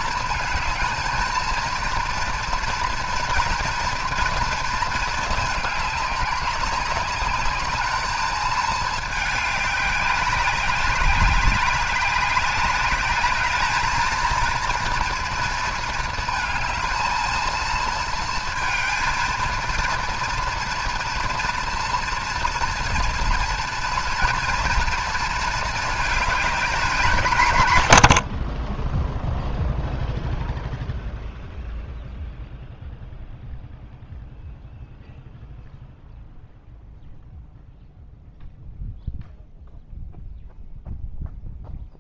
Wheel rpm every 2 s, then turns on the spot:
220, 230, 230, 200, 210, 200, 200, 230, 220, 220, 230, 230, 230, 220, 10, 0, 0, 0, 0, 0, 0.
none